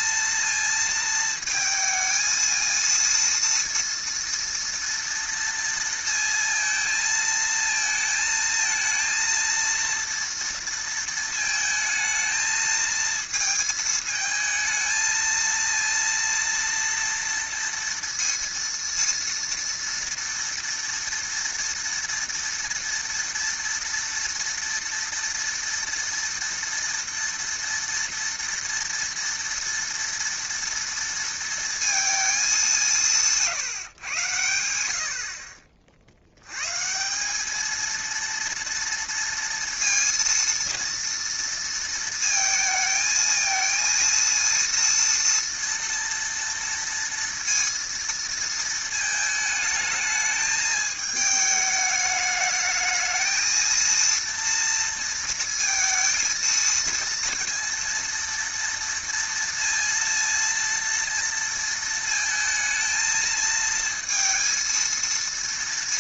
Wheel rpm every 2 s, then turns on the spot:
230, 220, 230, 230, 220, 230, 220, 220, 230, 230, 230, 230, 230, 230, 230, 230, 210, 100, 90, 230, 230, 220, 230, 230, 230, 210, 220, 230, 230, 230, 230, 220, 230.
none